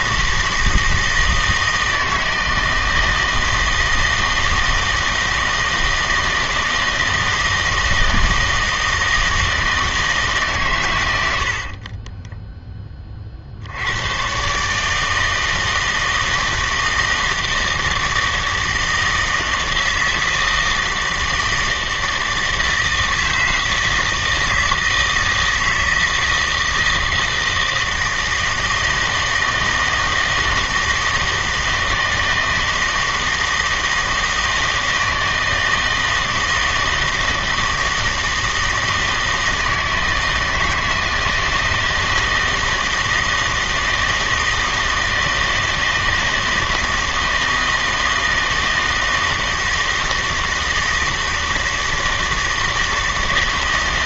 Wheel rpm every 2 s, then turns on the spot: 160, 160, 160, 160, 160, 130, 10, 150, 160, 160, 160, 160, 160, 160, 160, 160, 160, 160, 160, 160, 160, 160, 160, 160, 160, 160, 160.
none